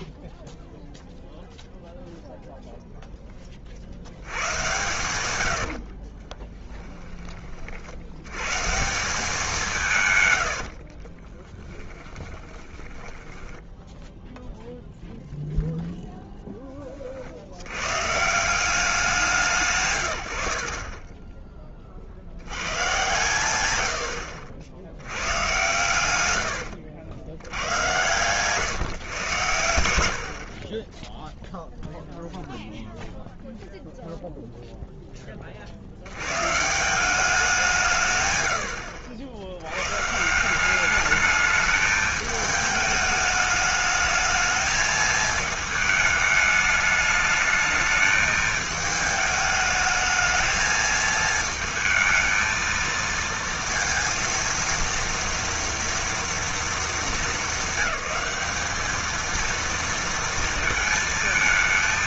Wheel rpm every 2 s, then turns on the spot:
0, 0, 110, 30, 130, 90, 20, 0, 10, 170, 50, 90, 70, 90, 120, 50, 0, 0, 140, 90, 180, 210, 220, 210, 210, 220, 230, 230, 230, 210, 230.
6-8 10-14 26-28